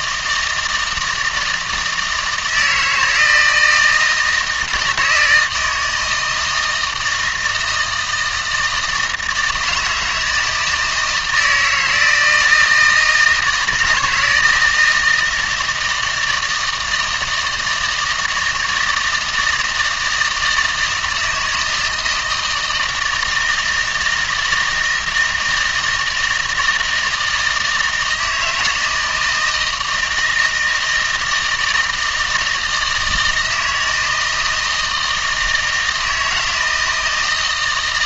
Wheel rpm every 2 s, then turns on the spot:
160, 170, 160, 160, 160, 160, 160, 160, 160, 160, 160, 160, 160, 160, 160, 160, 160, 160, 160.
none